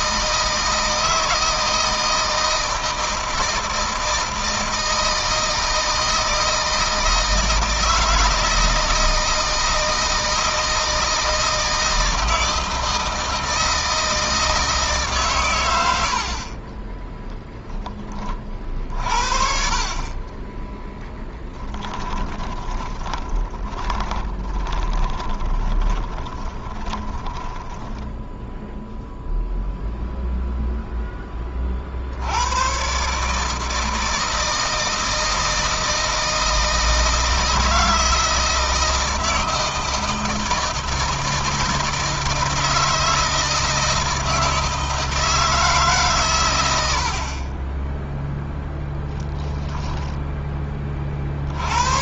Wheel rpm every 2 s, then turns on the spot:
160, 160, 160, 160, 160, 160, 160, 150, 20, 50, 10, 20, 10, 20, 0, 0, 110, 160, 160, 160, 160, 160, 160, 90, 0, 30.
22-28